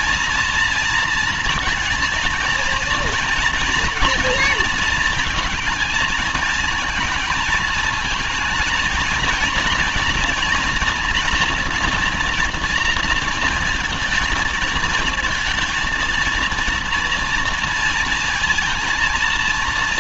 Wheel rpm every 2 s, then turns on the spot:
230, 230, 230, 230, 220, 230, 230, 230, 230, 230.
none